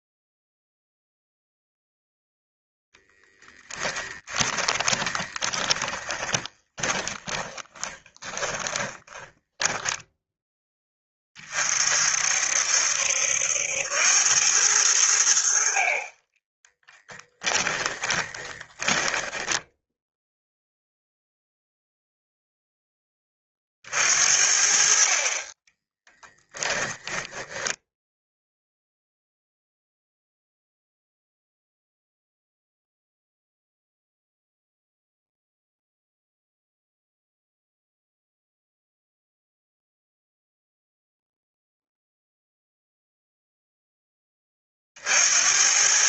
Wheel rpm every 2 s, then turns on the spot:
0, 0, 20, 20, 20, 20, 70, 90, 10, 20, 0, 10, 50, 10, 0, 0, 0, 0, 0, 0, 0, 0, 40.
4-10 16-20 26-28